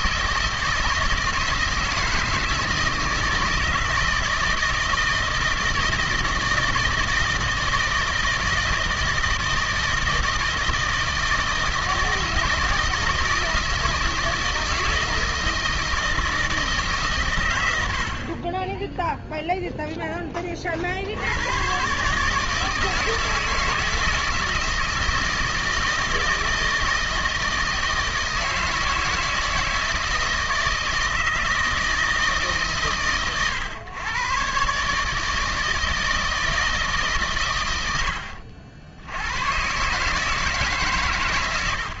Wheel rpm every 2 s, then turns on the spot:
160, 160, 160, 160, 160, 160, 160, 160, 160, 20, 20, 150, 160, 160, 160, 160, 140, 140, 160, 70, 150.
none